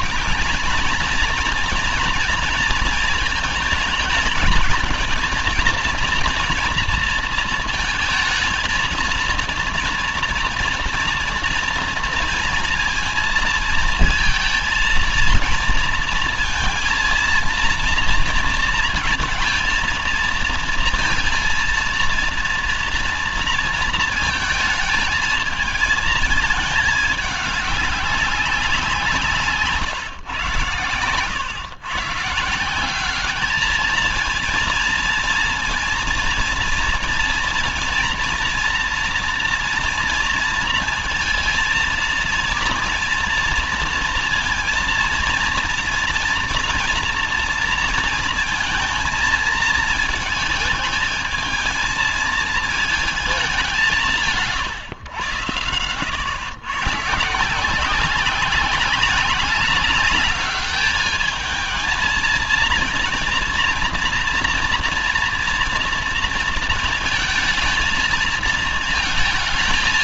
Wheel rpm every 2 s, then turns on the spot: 220, 230, 220, 230, 230, 240, 230, 230, 230, 230, 220, 230, 220, 220, 190, 120, 160, 230, 240, 230, 230, 230, 230, 240, 230, 220, 220, 160, 110, 190, 210, 230, 230, 230, 230.
none